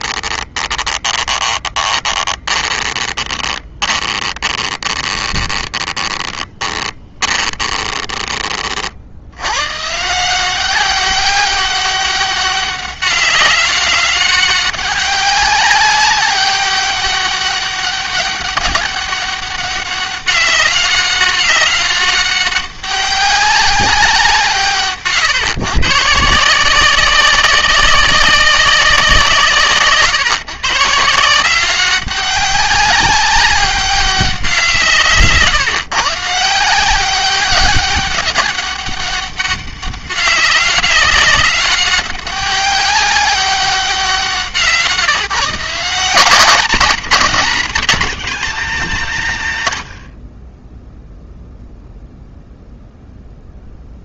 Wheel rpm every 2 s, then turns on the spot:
20, 20, 20, 20, 60, 190, 200, 200, 200, 200, 200, 200, 150, 190, 170, 160, 200, 150, 190, 200, 200, 200, 150, 200, 200, 0, 0.
0-8